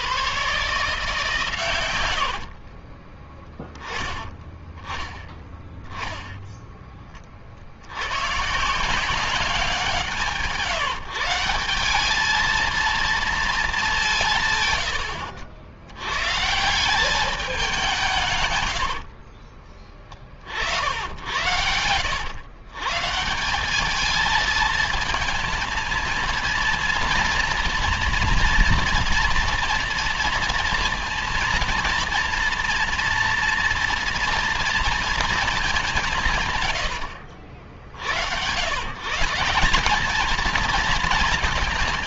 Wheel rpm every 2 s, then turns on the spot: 140, 40, 10, 10, 150, 160, 220, 130, 150, 120, 60, 130, 220, 230, 230, 230, 230, 240, 130, 110, 220.
2-4 14-16 18-20 36-38